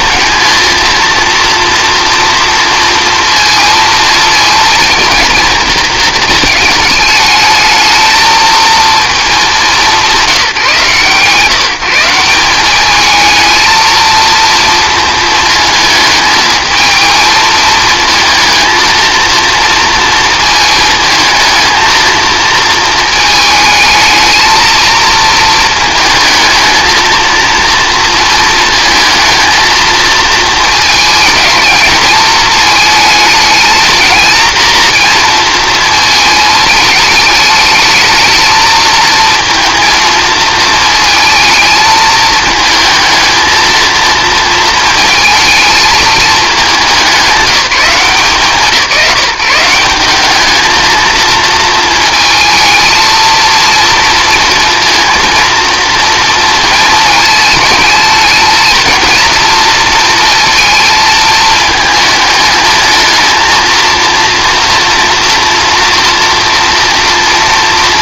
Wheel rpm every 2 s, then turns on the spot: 230, 230, 230, 220, 230, 160, 190, 230, 220, 230, 220, 220, 230, 220, 230, 220, 220, 230, 210, 220, 220, 220, 220, 200, 180, 220, 220, 230, 230, 230, 230, 220, 230, 230.
none